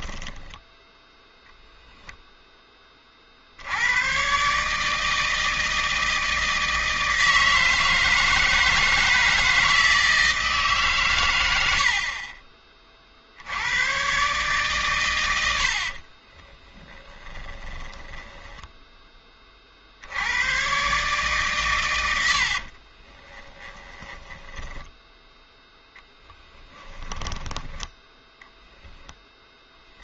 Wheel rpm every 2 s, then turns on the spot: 10, 10, 150, 160, 160, 150, 30, 140, 30, 10, 120, 50, 10, 10, 0.
0-2 16-18 22-28